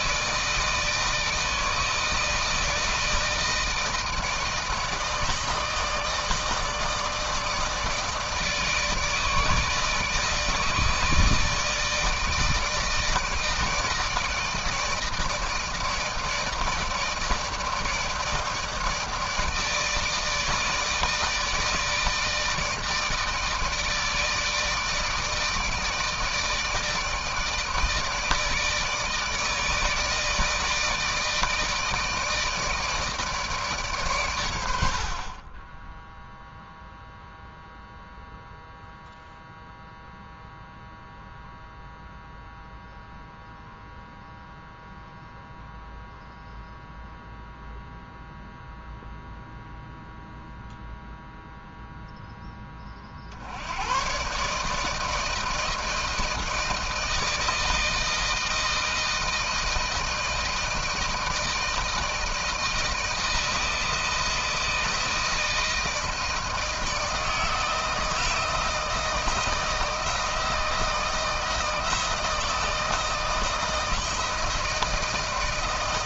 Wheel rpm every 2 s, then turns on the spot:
160, 160, 160, 160, 160, 160, 160, 160, 160, 160, 160, 150, 150, 160, 160, 160, 160, 80, 0, 0, 0, 0, 0, 0, 0, 0, 20, 150, 160, 160, 160, 160, 160, 160, 160, 160, 160, 160.
none